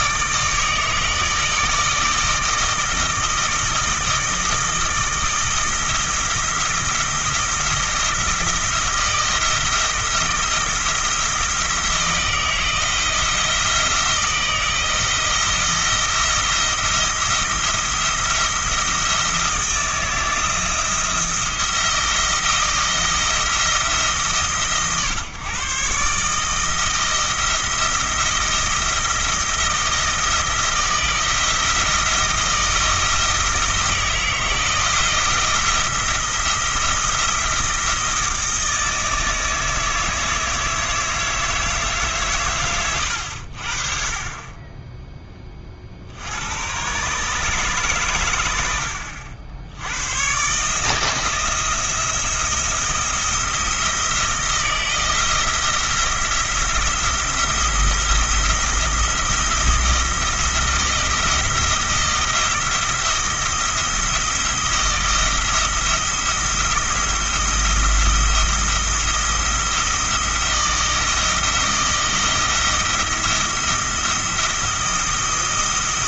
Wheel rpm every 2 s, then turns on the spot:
160, 160, 160, 170, 160, 170, 160, 170, 170, 160, 170, 170, 140, 160, 170, 170, 160, 160, 170, 160, 160, 110, 10, 130, 70, 150, 170, 170, 170, 170, 170, 170, 170, 170, 170, 170, 170, 170.
none